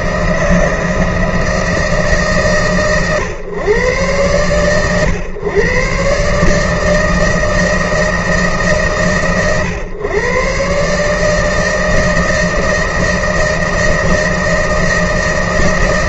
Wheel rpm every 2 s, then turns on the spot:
160, 140, 110, 140, 150, 120, 160, 160.
none